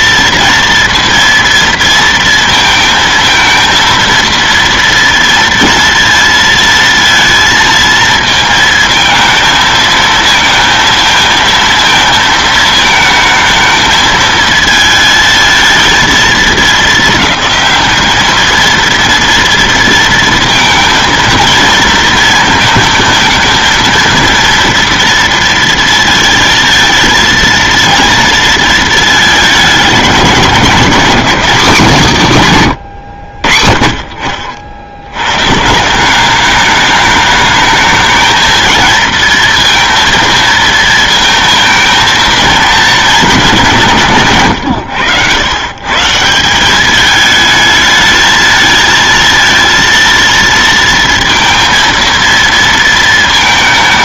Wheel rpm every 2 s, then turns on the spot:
230, 220, 230, 230, 220, 220, 220, 220, 210, 230, 230, 230, 230, 230, 220, 200, 140, 70, 210, 230, 220, 220, 100, 200, 230, 230, 230.
none